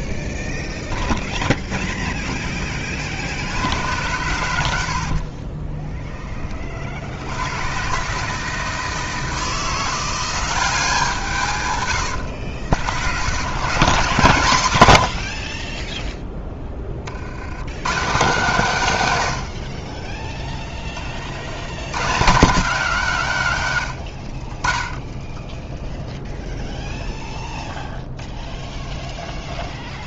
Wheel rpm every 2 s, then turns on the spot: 0, 30, 70, 50, 160, 180, 90, 110, 30, 160, 20, 180, 20, 0, 0.
4-6